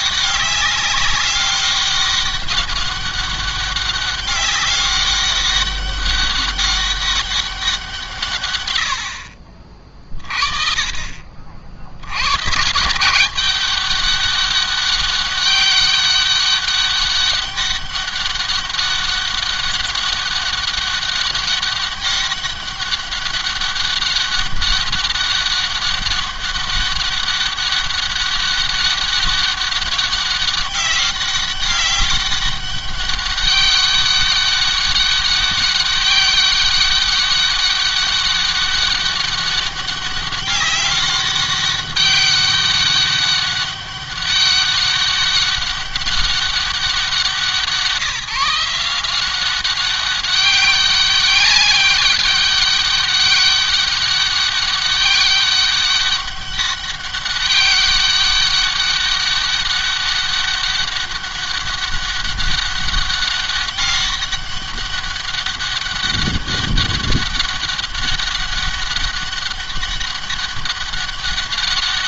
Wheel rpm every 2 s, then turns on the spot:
200, 200, 200, 200, 110, 40, 120, 200, 200, 200, 200, 200, 200, 200, 200, 200, 200, 200, 200, 200, 200, 200, 200, 190, 160, 200, 200, 200, 200, 200, 200, 200, 200, 200, 200, 200.
none